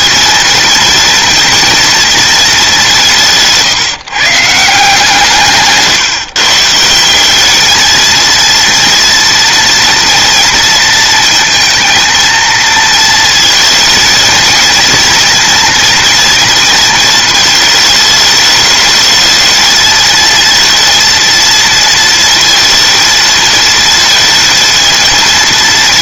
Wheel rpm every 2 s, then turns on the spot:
230, 230, 150, 140, 220, 230, 230, 230, 230, 210, 220, 230, 230.
none